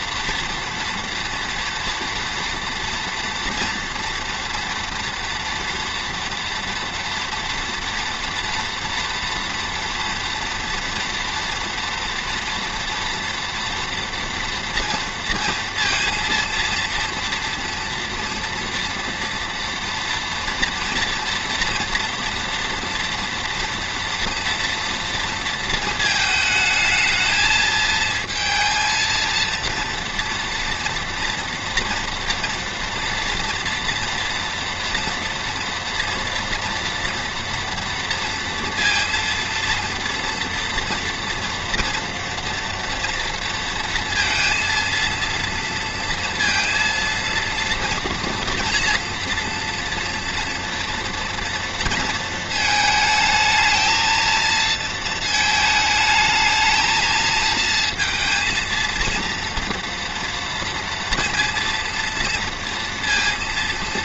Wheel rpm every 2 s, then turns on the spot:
230, 230, 230, 230, 230, 240, 230, 230, 230, 230, 230, 230, 230, 220, 230, 240, 240, 230, 230, 230, 240, 230, 230, 230, 230, 230, 220, 230, 220, 230, 230, 230.
none